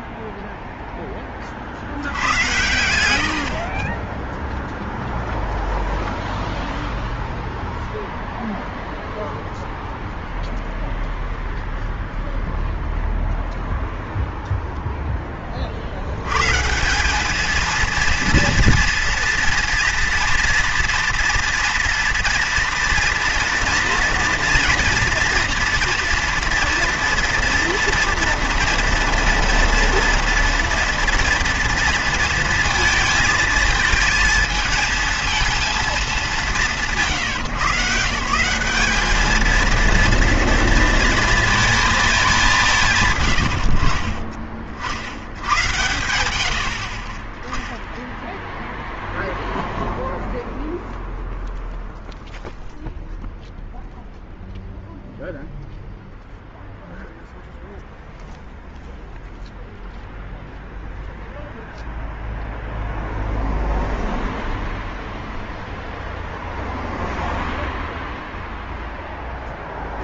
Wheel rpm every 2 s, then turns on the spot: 0, 90, 0, 0, 0, 0, 0, 0, 160, 240, 230, 230, 230, 230, 240, 230, 230, 220, 180, 200, 230, 180, 50, 60, 0, 0, 0, 0, 0, 0, 0, 0, 0, 0, 0.
none